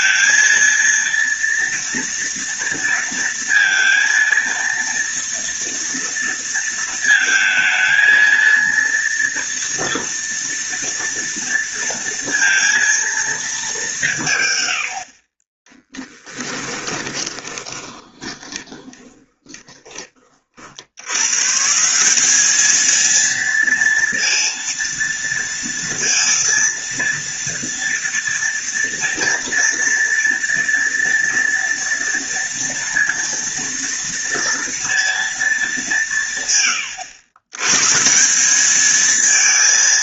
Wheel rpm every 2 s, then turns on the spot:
230, 230, 230, 230, 230, 230, 230, 130, 10, 20, 50, 210, 230, 230, 230, 230, 230, 230, 140, 190.
16-20